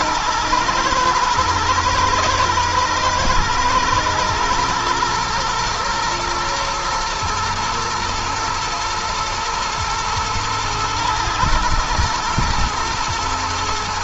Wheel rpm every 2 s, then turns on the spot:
110, 120, 110, 110, 110, 120, 120.
none